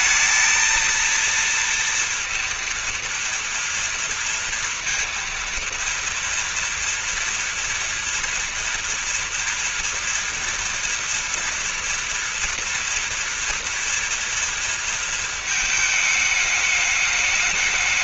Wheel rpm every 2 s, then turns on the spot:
230, 230, 230, 230, 230, 230, 230, 230, 210.
none